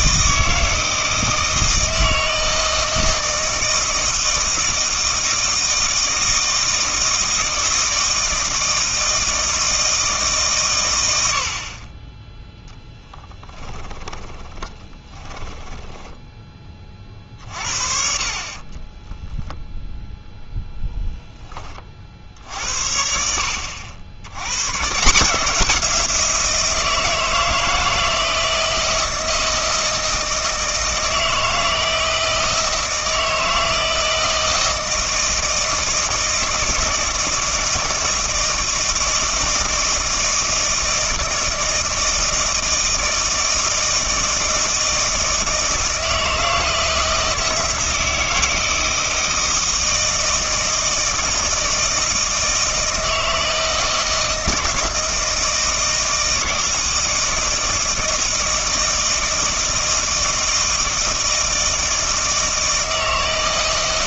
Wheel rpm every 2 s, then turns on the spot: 160, 160, 160, 160, 160, 120, 10, 30, 30, 20, 0, 70, 120, 170, 160, 160, 160, 160, 160, 160, 160, 160, 160, 160, 160, 160, 160, 160, 160, 160, 160, 160.
14-16 18-20